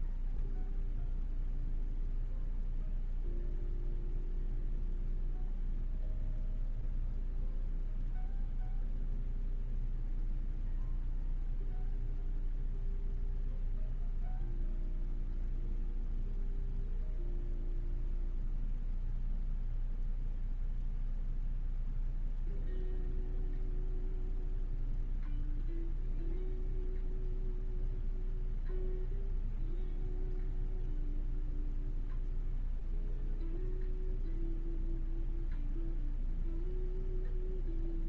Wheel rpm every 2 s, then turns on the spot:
0, 0, 0, 0, 0, 0, 0, 0, 0, 0, 0, 0, 0, 0, 0, 0, 0, 0, 0.
none